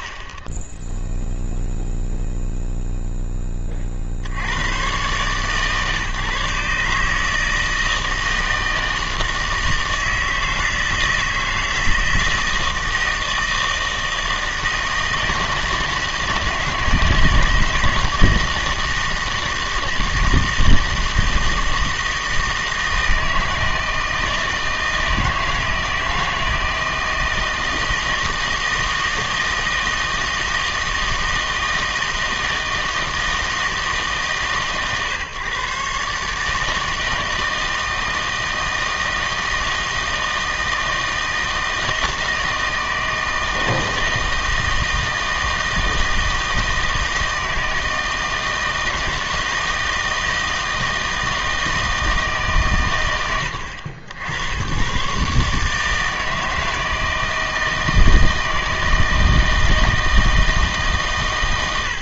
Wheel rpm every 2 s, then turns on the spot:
0, 0, 60, 150, 160, 160, 160, 160, 160, 160, 160, 160, 160, 160, 160, 160, 160, 140, 160, 160, 160, 160, 160, 160, 160, 160, 110, 120, 160, 160, 140.
none